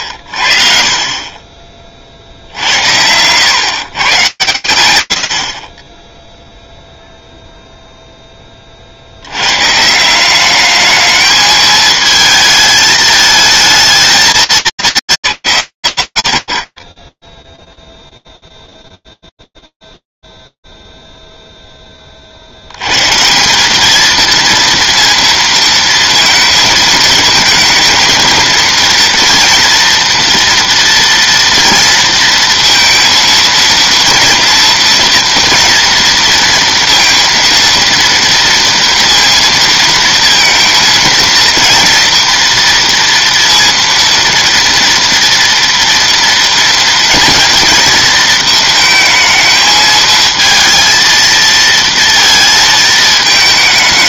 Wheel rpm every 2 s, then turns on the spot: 40, 70, 100, 0, 40, 210, 220, 170, 60, 0, 0, 70, 230, 220, 230, 230, 230, 230, 230, 230, 230, 240, 230, 230, 220, 230, 230.
none